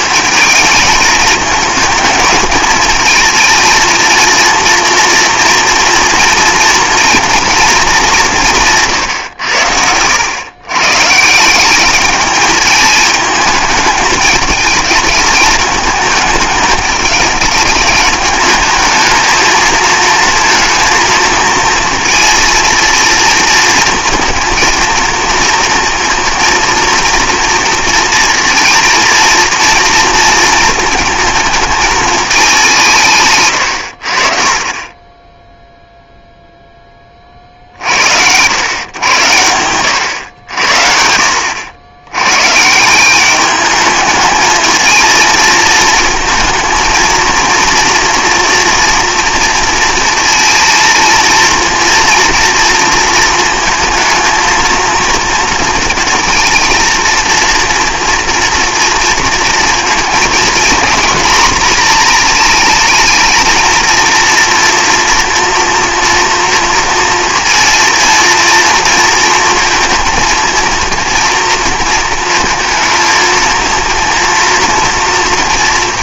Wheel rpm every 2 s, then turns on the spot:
220, 220, 230, 240, 160, 120, 210, 220, 210, 210, 230, 230, 230, 230, 230, 230, 180, 40, 10, 110, 80, 160, 220, 230, 230, 230, 230, 230, 230, 230, 230, 220, 230, 230, 230, 230, 230, 230.
none